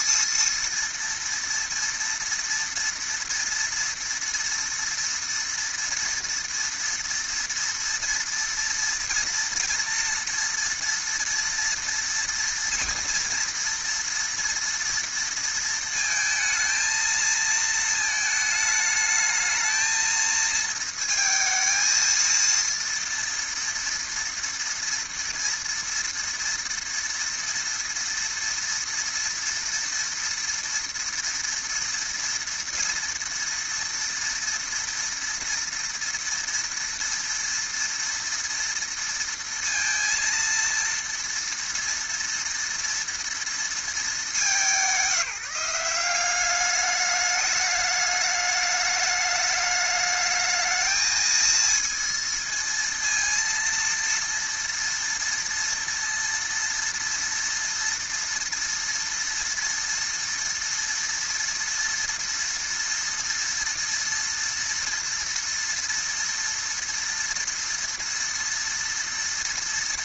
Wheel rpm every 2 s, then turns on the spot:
230, 230, 230, 230, 230, 230, 230, 230, 220, 220, 220, 230, 230, 230, 230, 230, 230, 230, 230, 230, 230, 230, 190, 200, 210, 220, 230, 230, 230, 230, 230, 230, 230, 230, 230.
none